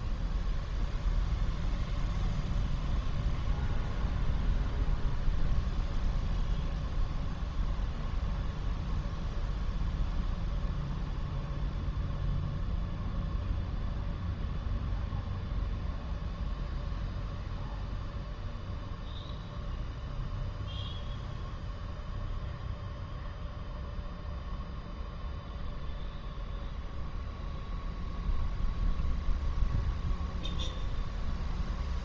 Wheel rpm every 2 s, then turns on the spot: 0, 0, 0, 0, 0, 0, 0, 0, 0, 0, 0, 0, 0, 0, 0, 0.
none